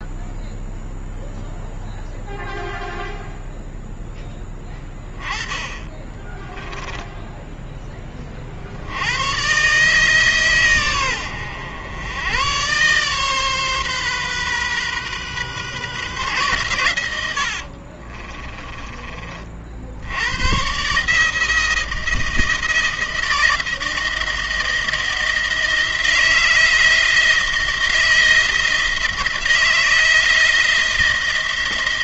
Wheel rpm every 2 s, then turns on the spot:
0, 0, 10, 10, 50, 120, 120, 130, 120, 20, 120, 170, 170, 170, 170, 170.
6-8 18-20